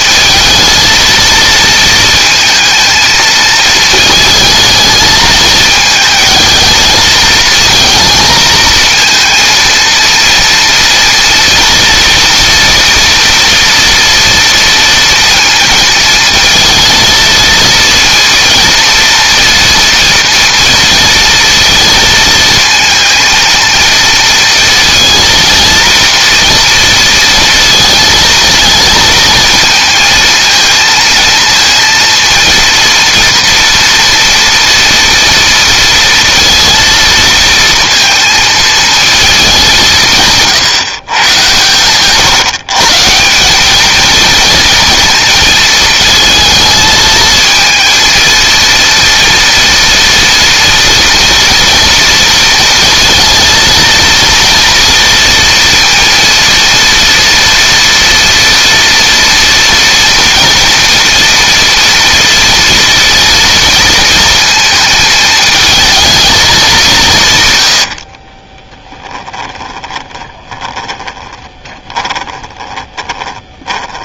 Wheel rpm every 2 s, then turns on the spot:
220, 220, 220, 220, 230, 240, 230, 230, 220, 230, 230, 230, 230, 230, 230, 230, 230, 230, 230, 220, 130, 160, 220, 220, 230, 230, 230, 230, 230, 230, 230, 220, 220, 150, 10, 10, 20.
68-74